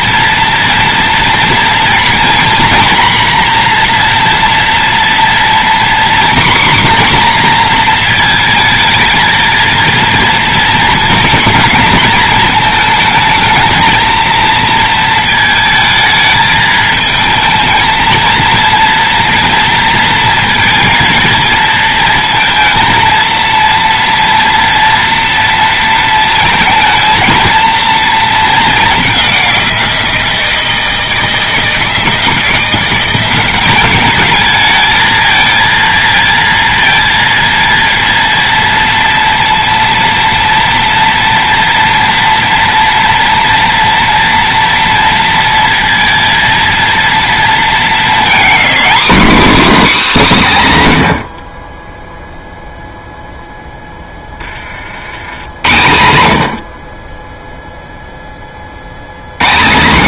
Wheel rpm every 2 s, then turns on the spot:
230, 240, 240, 260, 220, 230, 220, 230, 220, 230, 220, 230, 240, 220, 200, 160, 180, 220, 230, 230, 230, 230, 230, 230, 250, 150, 0, 60, 40, 60.
none